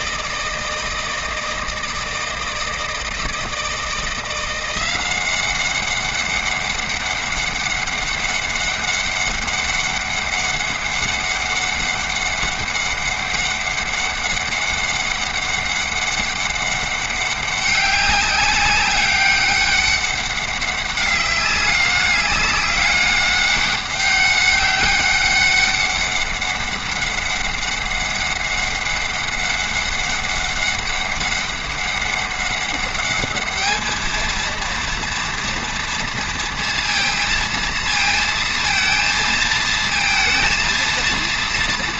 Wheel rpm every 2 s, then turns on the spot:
160, 160, 180, 200, 200, 200, 200, 200, 200, 190, 200, 200, 200, 200, 200, 200, 200, 230, 230, 230, 230.
none